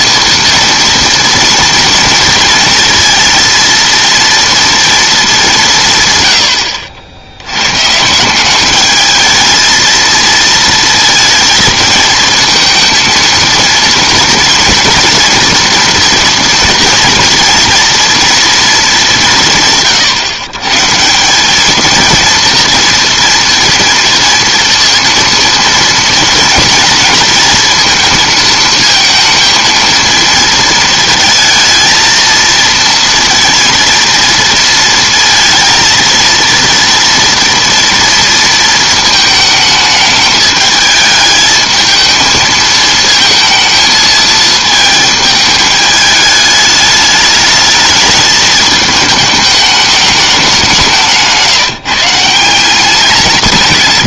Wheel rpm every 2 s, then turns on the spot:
230, 230, 230, 90, 200, 230, 220, 230, 230, 220, 130, 230, 230, 230, 220, 220, 230, 230, 230, 230, 220, 220, 220, 210, 210, 190, 180.
none